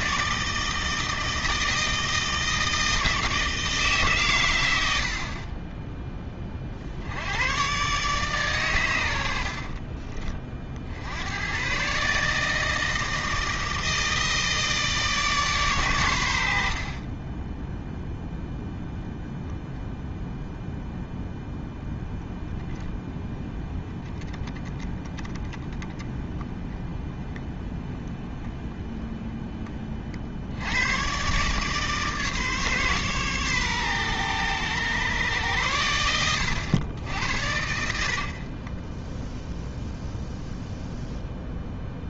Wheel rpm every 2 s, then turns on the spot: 160, 150, 20, 120, 40, 130, 160, 120, 0, 0, 0, 10, 20, 10, 20, 140, 130, 100, 100, 0, 0.
8-10